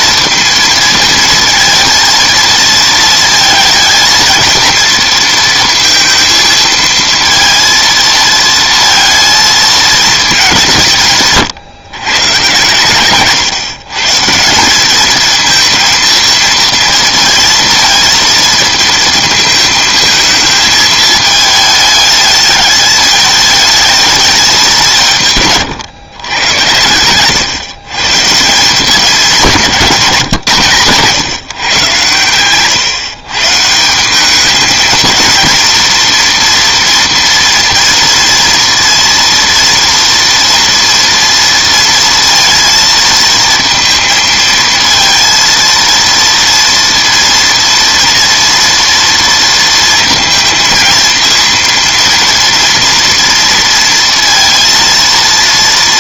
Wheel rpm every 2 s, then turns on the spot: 220, 230, 230, 230, 230, 190, 120, 180, 220, 230, 220, 220, 190, 100, 170, 130, 120, 220, 230, 230, 230, 230, 220, 230, 230, 230, 230, 230.
none